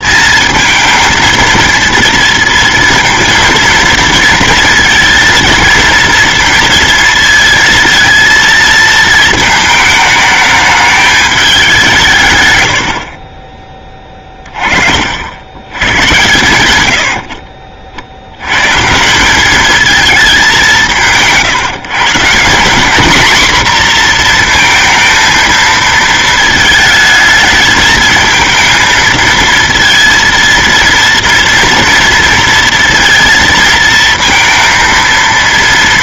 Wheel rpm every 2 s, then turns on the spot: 230, 230, 230, 230, 220, 210, 90, 40, 90, 140, 150, 190, 230, 220, 220, 230, 230, 230.
none